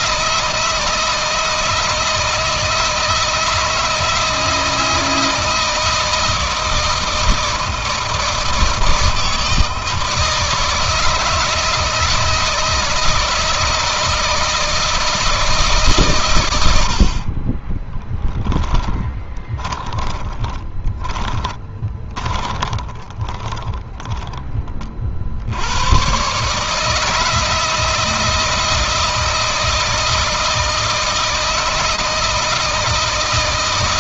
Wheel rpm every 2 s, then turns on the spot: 160, 160, 160, 160, 160, 160, 160, 160, 120, 30, 30, 20, 20, 120, 160, 160, 160.
18-24